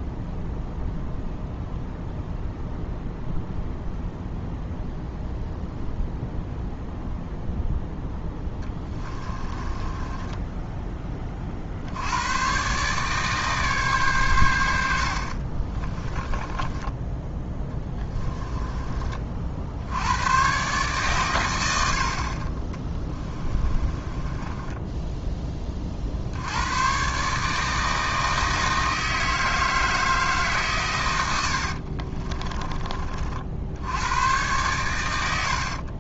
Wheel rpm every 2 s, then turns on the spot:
0, 0, 0, 0, 10, 10, 130, 90, 20, 20, 130, 30, 10, 110, 160, 150, 20, 110.
8-10 18-20 22-26